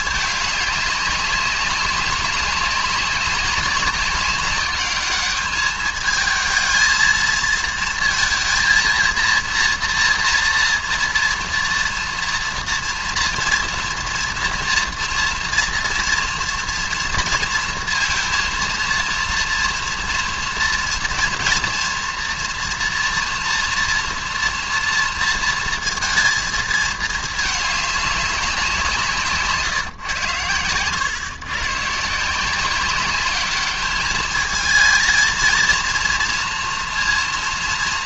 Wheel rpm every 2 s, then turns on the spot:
210, 200, 200, 220, 230, 230, 230, 230, 230, 230, 230, 230, 230, 220, 180, 110, 190, 220, 230.
30-32